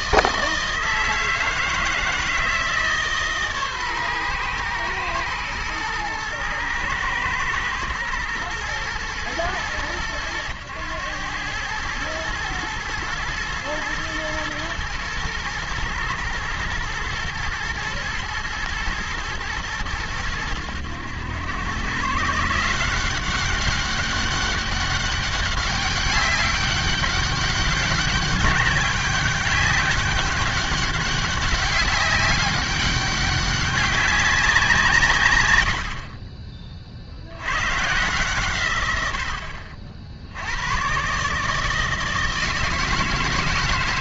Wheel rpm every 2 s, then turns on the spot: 160, 160, 120, 110, 110, 100, 110, 110, 110, 120, 100, 160, 200, 200, 200, 200, 190, 180, 30, 120, 100, 160.
none